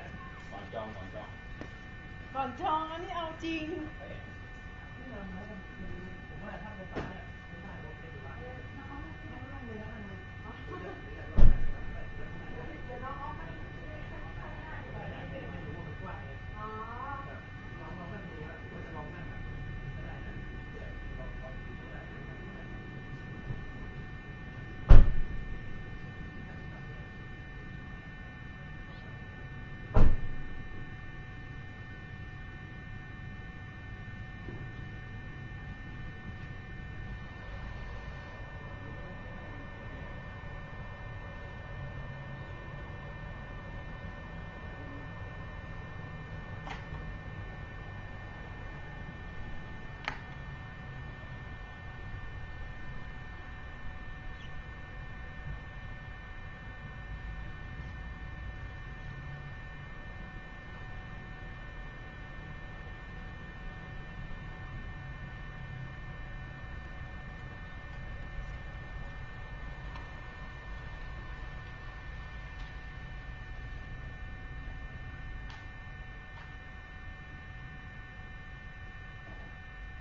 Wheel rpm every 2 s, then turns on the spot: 0, 0, 0, 0, 0, 0, 0, 0, 0, 0, 0, 0, 0, 0, 0, 0, 0, 0, 0, 0, 0, 0, 0, 0, 0, 0, 0, 0, 0, 0, 0, 0, 0, 0, 0, 0, 0, 0, 0, 0.
none